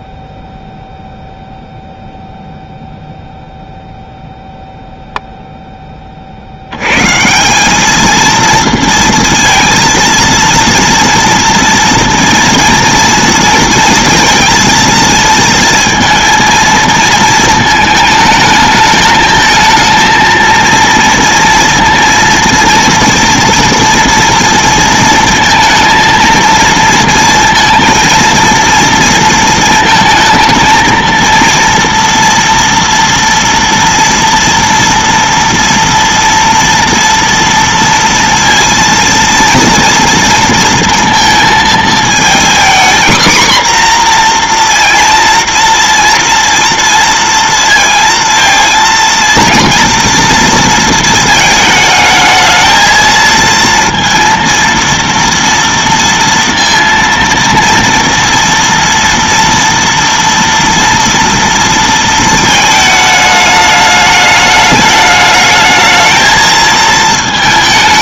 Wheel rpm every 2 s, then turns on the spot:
0, 0, 0, 80, 230, 230, 230, 230, 230, 220, 230, 230, 230, 230, 230, 230, 230, 230, 230, 230, 230, 240, 240, 230, 230, 230, 220, 230, 230, 230, 230, 220, 210, 220.
none